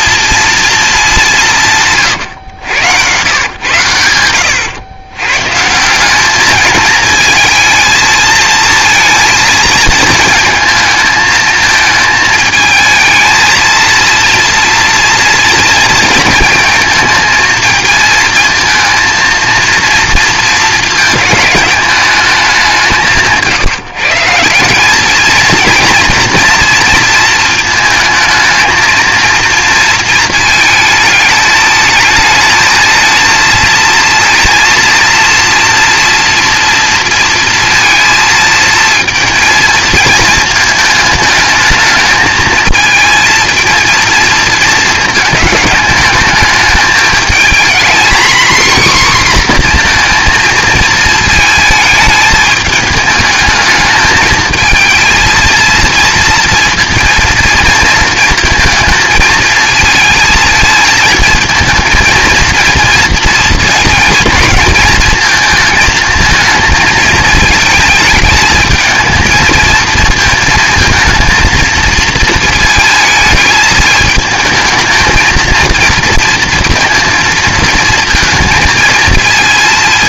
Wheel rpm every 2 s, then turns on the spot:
230, 100, 100, 220, 220, 220, 220, 230, 230, 230, 220, 190, 180, 230, 220, 220, 220, 230, 230, 230, 220, 220, 220, 220, 250, 220, 210, 220, 230, 230, 220, 240, 230, 220, 220, 230, 230, 220, 230, 220.
none